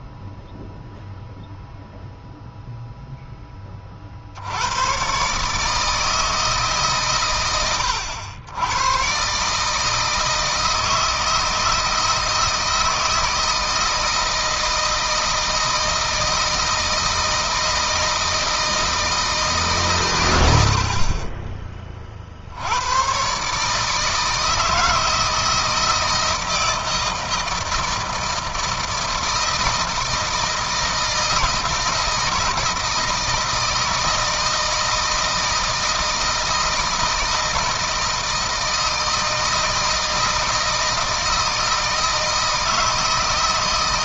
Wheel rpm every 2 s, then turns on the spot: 0, 0, 120, 140, 110, 160, 160, 160, 160, 160, 60, 100, 160, 160, 160, 160, 160, 160, 160, 160, 160, 160.
none